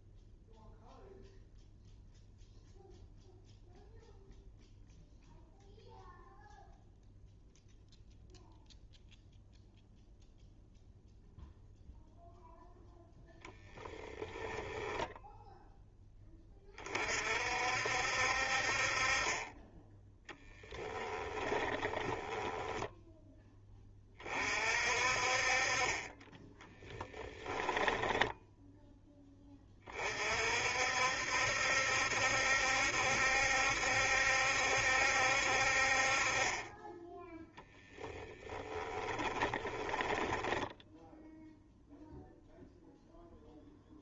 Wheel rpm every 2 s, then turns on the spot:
0, 0, 0, 0, 0, 0, 0, 10, 30, 40, 20, 10, 50, 10, 0, 60, 70, 70, 10, 10, 10, 0.
14-16 20-22 26-28 38-40